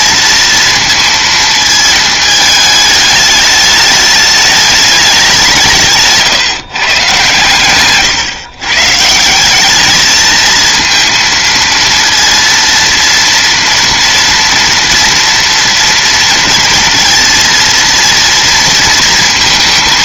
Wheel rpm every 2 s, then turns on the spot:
230, 210, 210, 140, 150, 230, 230, 230, 230, 230.
none